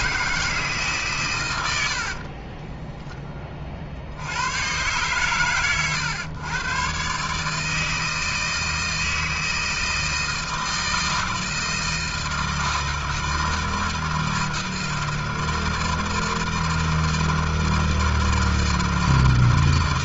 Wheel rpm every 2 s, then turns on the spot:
160, 30, 100, 120, 160, 160, 160, 170, 160, 160.
2-4